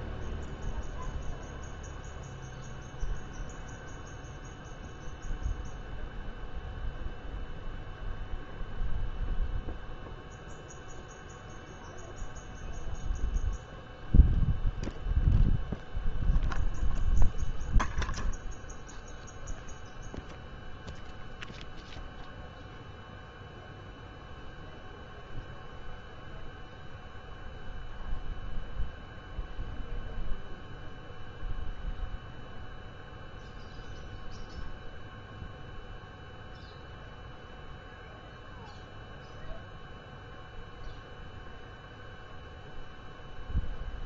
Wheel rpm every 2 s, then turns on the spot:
0, 0, 0, 0, 0, 0, 0, 0, 0, 0, 0, 0, 0, 0, 0, 0, 0, 0, 0, 0, 0, 0.
none